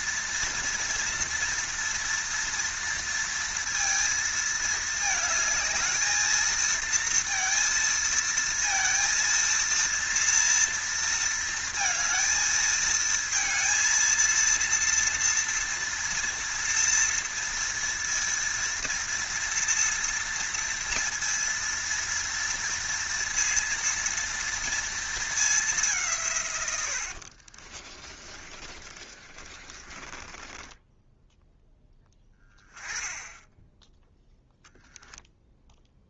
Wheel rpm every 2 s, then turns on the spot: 240, 230, 220, 220, 230, 230, 220, 230, 230, 230, 230, 230, 230, 120, 30, 20, 10, 0.
28-32